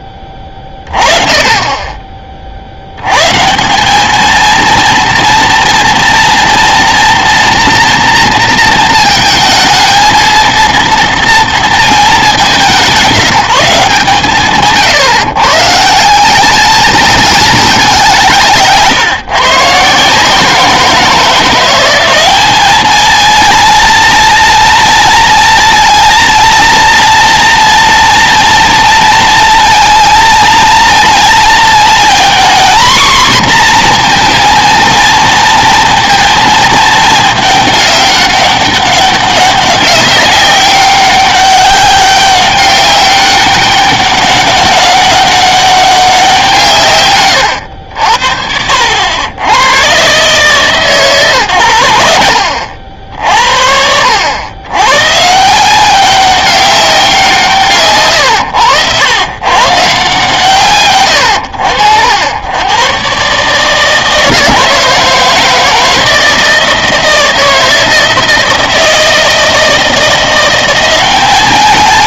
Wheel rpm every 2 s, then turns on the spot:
20, 70, 230, 230, 230, 230, 190, 150, 220, 150, 170, 220, 230, 230, 230, 230, 240, 230, 220, 200, 190, 200, 200, 150, 70, 150, 70, 110, 190, 100, 130, 100, 160, 160, 160, 180.
none